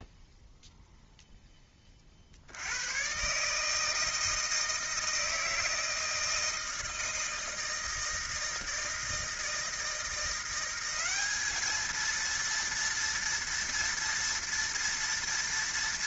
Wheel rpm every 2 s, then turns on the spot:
0, 120, 160, 160, 160, 190, 230, 230.
none